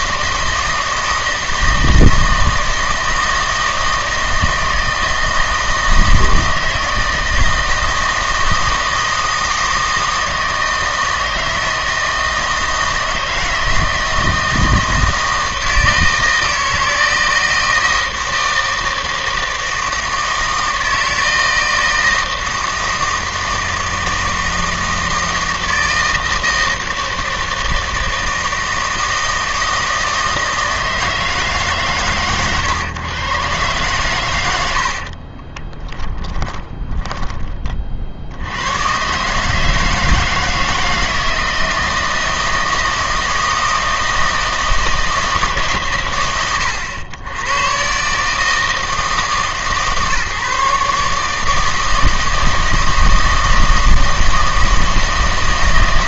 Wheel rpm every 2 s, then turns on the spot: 160, 160, 160, 160, 160, 160, 160, 160, 160, 160, 160, 160, 160, 160, 160, 160, 120, 70, 10, 100, 160, 160, 160, 100, 160, 150, 160, 160.
none